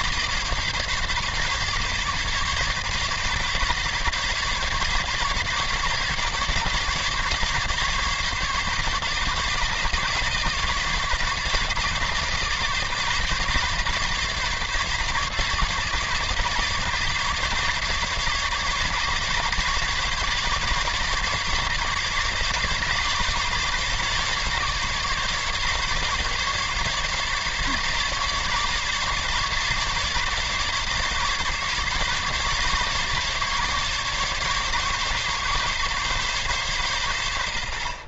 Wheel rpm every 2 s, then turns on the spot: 150, 140, 140, 150, 150, 150, 140, 140, 150, 150, 150, 150, 140, 150, 140, 150, 150, 140, 140.
none